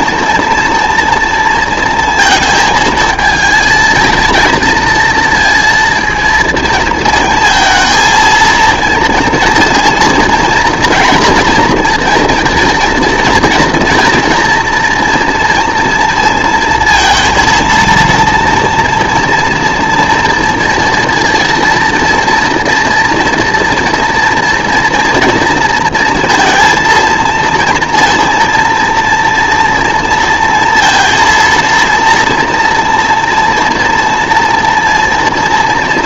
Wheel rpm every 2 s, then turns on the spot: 240, 230, 230, 230, 230, 240, 240, 240, 230, 230, 230, 230, 230, 230, 240, 230, 240, 240.
none